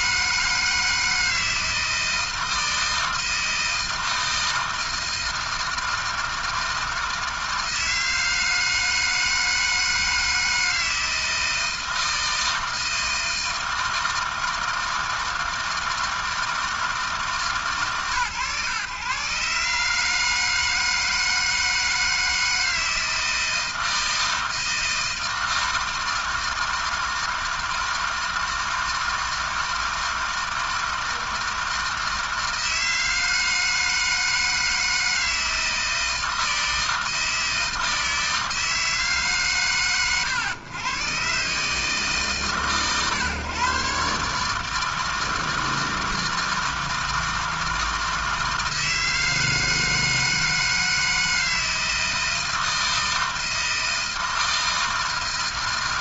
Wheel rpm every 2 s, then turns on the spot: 160, 160, 160, 160, 160, 160, 160, 160, 160, 120, 160, 160, 160, 160, 160, 160, 160, 160, 160, 160, 120, 130, 160, 160, 160, 160, 160, 160.
none